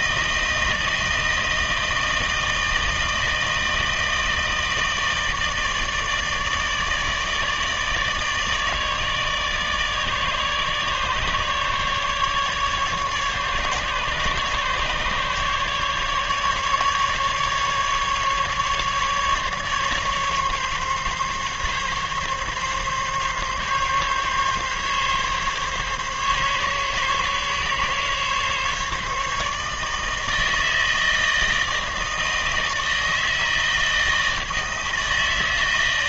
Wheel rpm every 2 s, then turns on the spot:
160, 160, 160, 150, 160, 150, 150, 140, 150, 140, 140, 140, 140, 140, 140, 160, 160, 160.
none